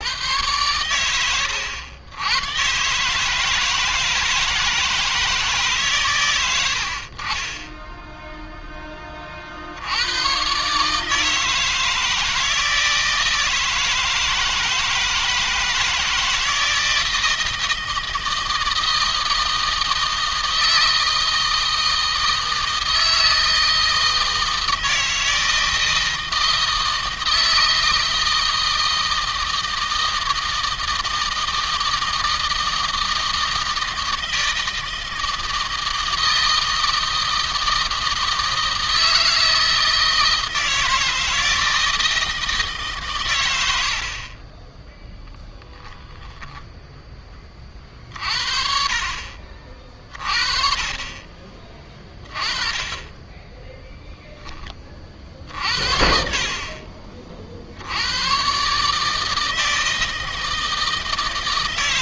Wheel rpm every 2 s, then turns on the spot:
100, 140, 160, 50, 20, 150, 160, 160, 160, 160, 160, 160, 160, 160, 160, 160, 160, 160, 160, 160, 160, 130, 10, 10, 60, 40, 20, 30, 40, 150, 160.
44-46